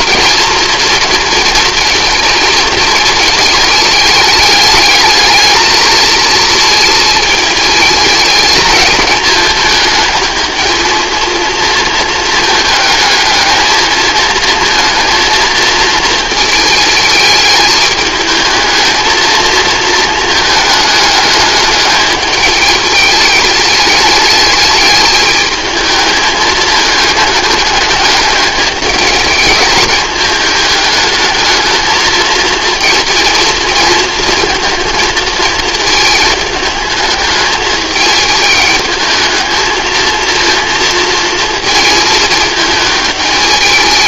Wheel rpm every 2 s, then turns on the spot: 230, 220, 210, 220, 220, 230, 220, 230, 220, 220, 210, 210, 210, 210, 210, 210, 230, 220, 220, 220, 230, 210.
none